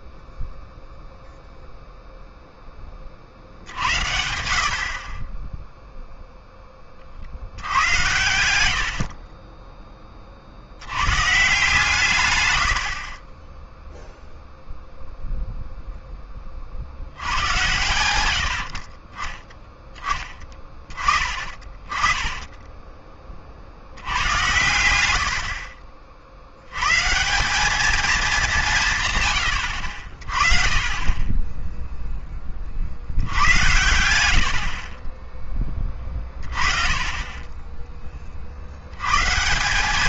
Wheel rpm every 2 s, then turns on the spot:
0, 20, 60, 20, 80, 80, 80, 0, 50, 60, 20, 20, 110, 110, 170, 30, 50, 50, 30, 70.
22-24